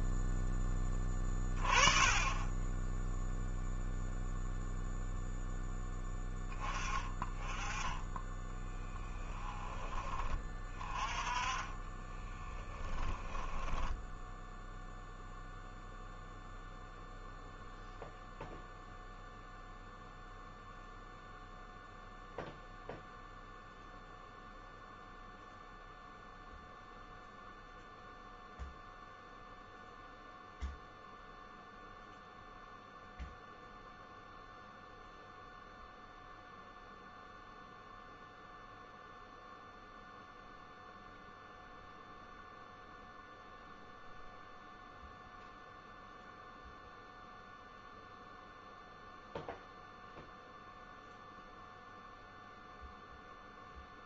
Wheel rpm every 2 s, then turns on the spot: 10, 10, 0, 20, 10, 20, 10, 0, 0, 0, 0, 0, 0, 0, 0, 0, 0, 0, 0, 0, 0, 0, 0, 0, 0, 0, 0.
12-14